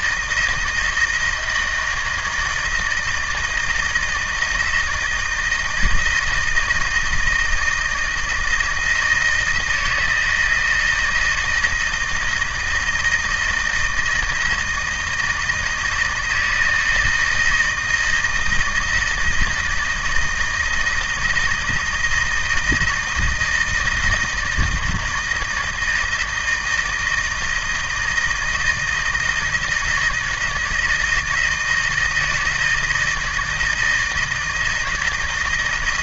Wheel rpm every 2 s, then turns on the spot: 160, 160, 160, 160, 160, 160, 170, 160, 160, 160, 160, 160, 160, 160, 160, 160, 160, 160.
none